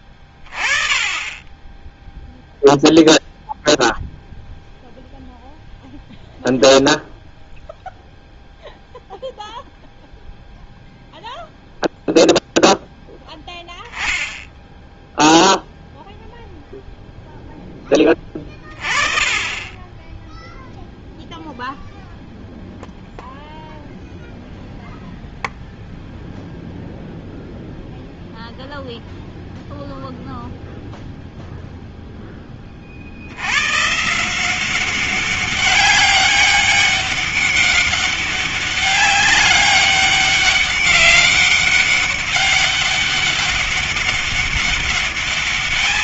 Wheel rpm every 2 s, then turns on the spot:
20, 0, 0, 0, 0, 0, 0, 0, 0, 20, 10, 0, 0, 0, 0, 0, 10, 160, 200, 190, 200, 200, 200.
none